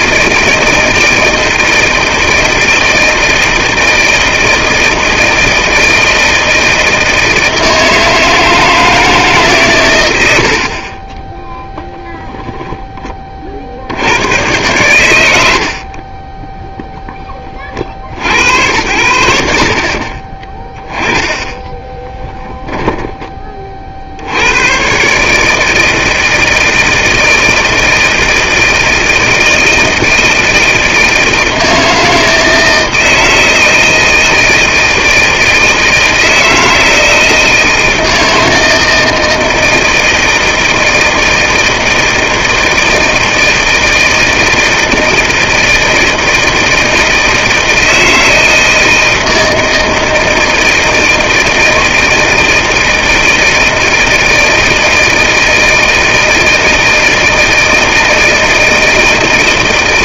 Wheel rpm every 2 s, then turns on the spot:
160, 160, 160, 160, 160, 70, 20, 100, 10, 80, 20, 10, 100, 160, 160, 160, 160, 160, 160, 160, 160, 160, 160, 160, 160, 160, 160, 160, 160, 160.
10-12 16-18 20-22